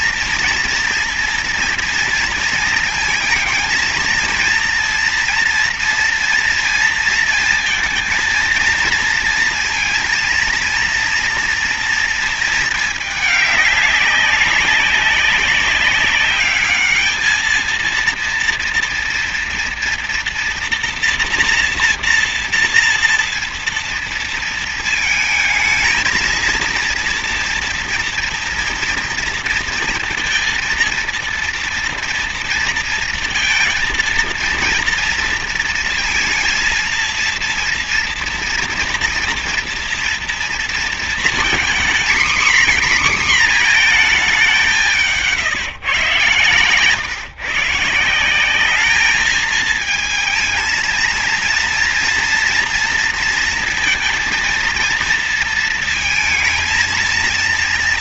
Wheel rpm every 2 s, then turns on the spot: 240, 230, 230, 230, 230, 230, 220, 200, 210, 240, 230, 230, 230, 230, 230, 230, 230, 230, 230, 240, 230, 260, 200, 140, 200, 230, 230, 230, 230.
none